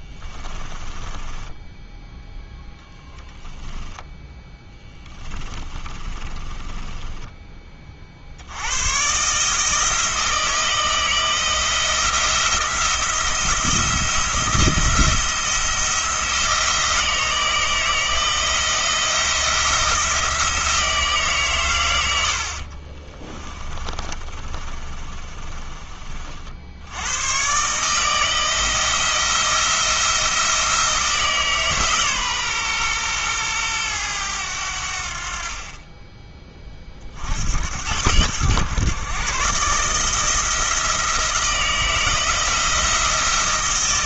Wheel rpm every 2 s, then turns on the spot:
20, 0, 10, 20, 90, 160, 170, 170, 160, 170, 170, 60, 30, 70, 160, 160, 130, 80, 30, 120, 160, 160.
0-2 4-8 22-26